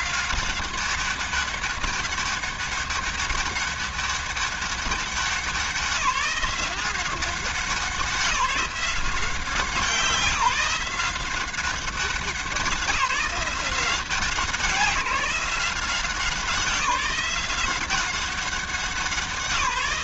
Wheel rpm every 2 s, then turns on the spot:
190, 200, 190, 190, 180, 170, 180, 180, 190, 180.
none